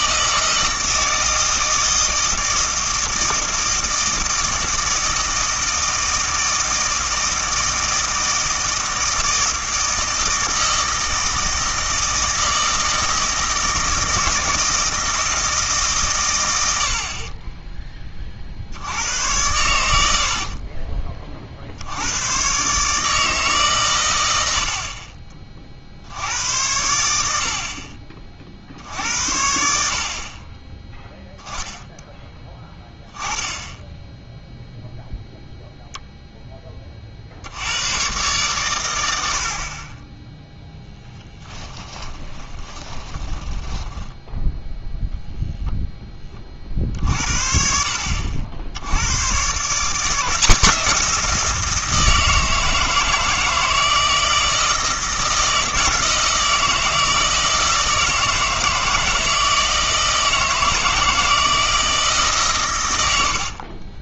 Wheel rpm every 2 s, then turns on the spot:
160, 160, 160, 160, 160, 160, 160, 160, 70, 70, 40, 130, 70, 90, 60, 20, 10, 0, 20, 110, 0, 20, 10, 40, 80, 170, 160, 160, 160, 160, 160, 110.
20-22 42-44